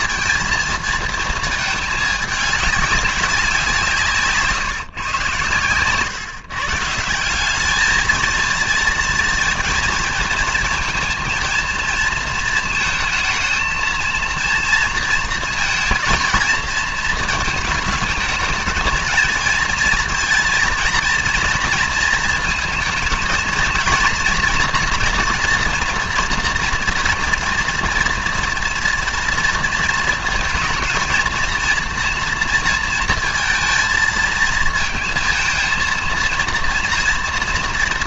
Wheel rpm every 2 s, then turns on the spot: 230, 210, 140, 150, 230, 230, 220, 230, 230, 220, 230, 230, 240, 230, 240, 230, 230, 230, 240.
none